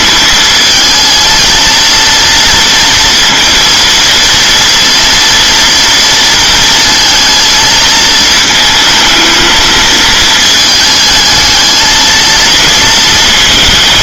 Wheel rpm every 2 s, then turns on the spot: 220, 230, 230, 230, 220, 220, 220.
none